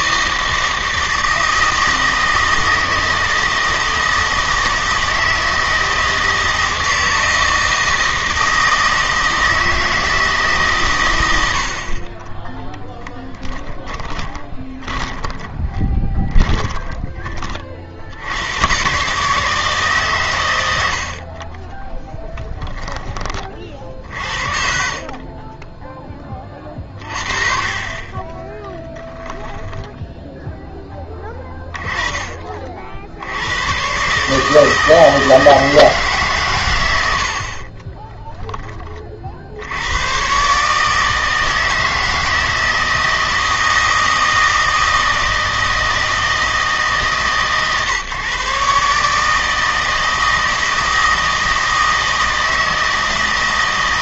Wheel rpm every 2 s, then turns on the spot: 160, 160, 160, 160, 160, 130, 10, 20, 20, 120, 100, 10, 40, 40, 10, 10, 50, 160, 100, 20, 150, 160, 160, 150, 140, 160, 160.
14-18 20-24 28-30